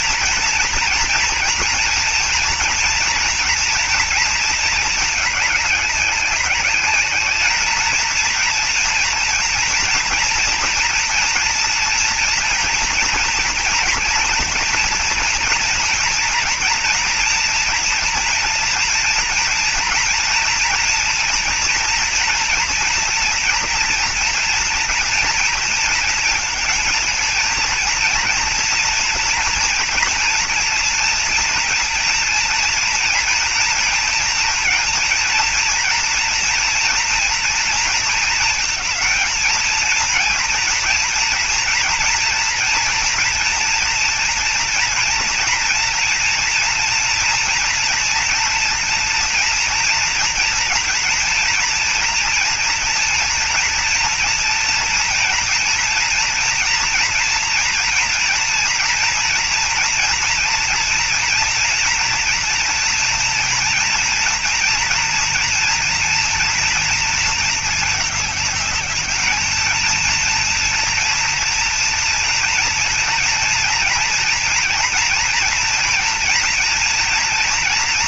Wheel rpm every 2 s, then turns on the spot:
240, 230, 230, 200, 220, 230, 230, 240, 230, 240, 230, 230, 240, 230, 230, 230, 230, 230, 230, 220, 230, 230, 230, 230, 230, 230, 230, 230, 230, 240, 240, 230, 230, 230, 210, 230, 230, 230, 230.
none